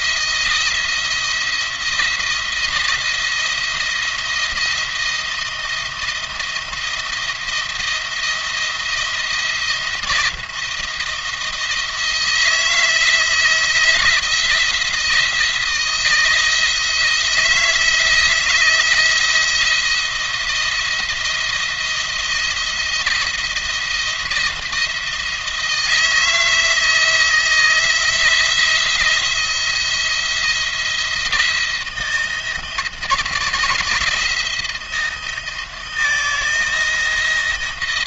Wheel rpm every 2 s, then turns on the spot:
170, 170, 170, 170, 170, 170, 170, 170, 170, 160, 170, 170, 170, 160, 170, 170, 160, 160, 160.
none